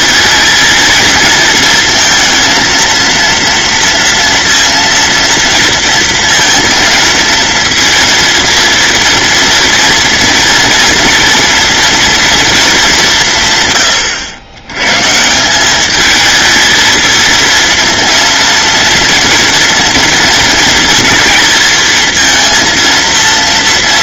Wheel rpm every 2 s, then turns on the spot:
220, 230, 230, 230, 230, 230, 210, 110, 220, 230, 230, 230.
none